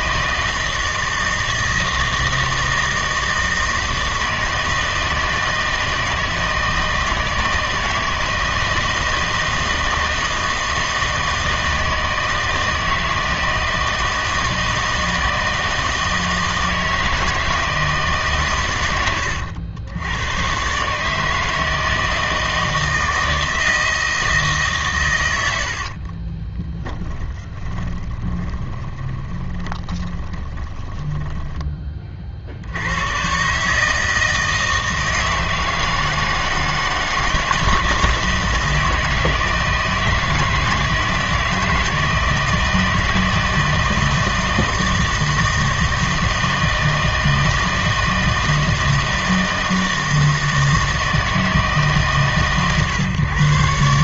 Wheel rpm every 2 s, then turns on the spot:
160, 160, 160, 160, 160, 160, 160, 160, 160, 120, 130, 160, 140, 20, 20, 20, 60, 160, 160, 160, 160, 160, 160, 160, 160, 160, 130.
26-32